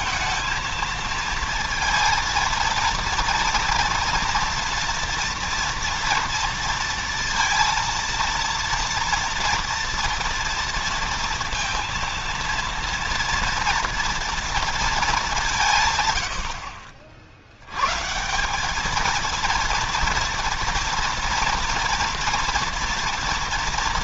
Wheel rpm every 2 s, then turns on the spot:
230, 230, 230, 230, 230, 230, 230, 230, 50, 180, 230, 240.
none